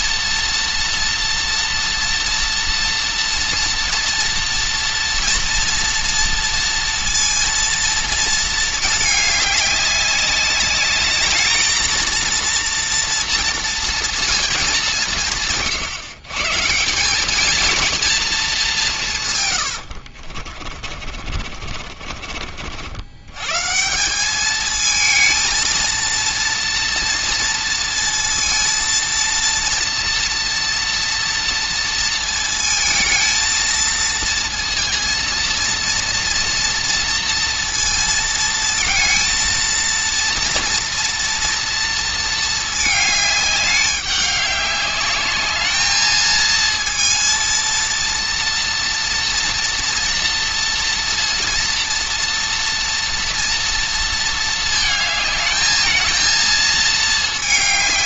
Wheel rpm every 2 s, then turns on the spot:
230, 230, 230, 230, 210, 200, 230, 200, 180, 180, 40, 70, 220, 230, 230, 230, 220, 230, 230, 230, 230, 220, 200, 230, 240, 230, 230, 220, 220.
20-22